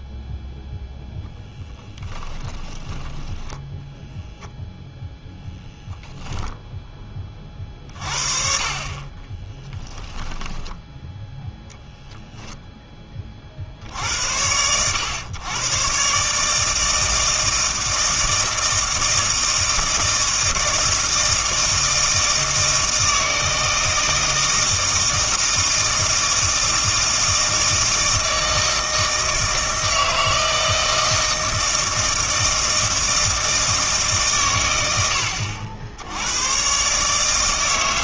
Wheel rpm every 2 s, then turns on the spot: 0, 10, 0, 0, 40, 10, 0, 80, 150, 160, 160, 160, 160, 160, 160, 160, 160, 110, 110.
2-4